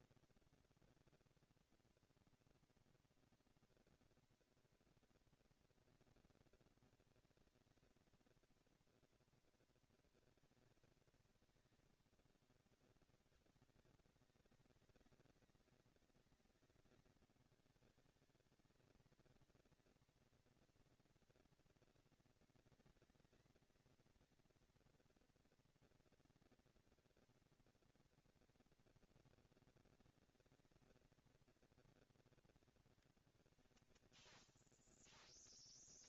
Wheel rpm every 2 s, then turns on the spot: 230, 230, 230, 230, 230, 220, 200, 200, 190, 220, 230, 220, 230, 230, 230, 230, 230, 230.
none